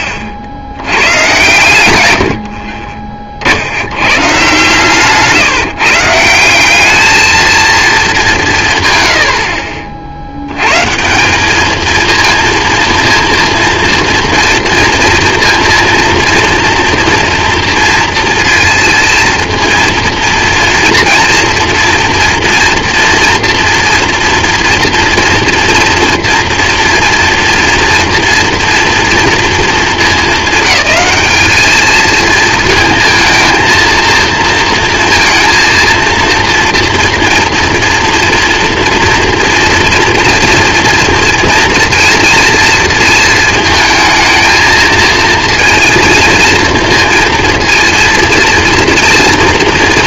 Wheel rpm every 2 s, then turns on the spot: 80, 50, 140, 190, 140, 160, 230, 230, 230, 230, 230, 230, 240, 240, 230, 220, 230, 230, 230, 230, 230, 230, 220, 230, 230.
none